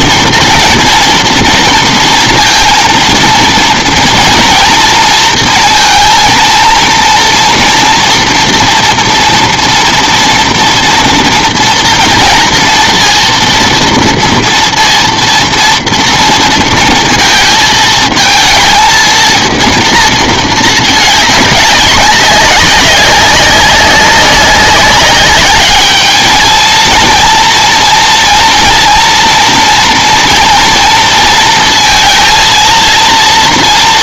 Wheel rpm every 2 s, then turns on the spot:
240, 230, 230, 230, 230, 230, 230, 230, 230, 230, 220, 190, 200, 230, 230, 230, 230.
none